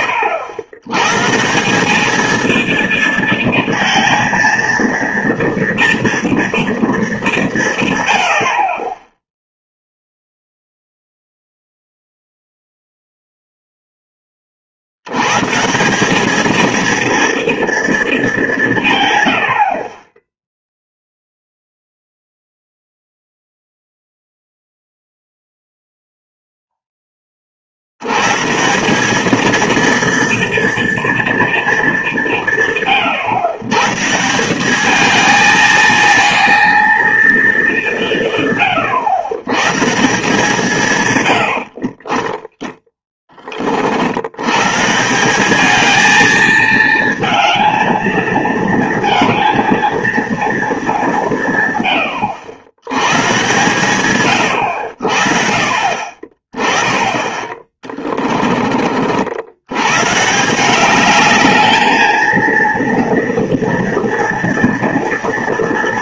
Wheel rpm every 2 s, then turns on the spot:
100, 230, 230, 230, 60, 0, 0, 50, 230, 180, 0, 0, 0, 0, 160, 230, 150, 200, 230, 130, 160, 20, 120, 220, 230, 220, 100, 100, 30, 30, 180, 230, 230.
42-44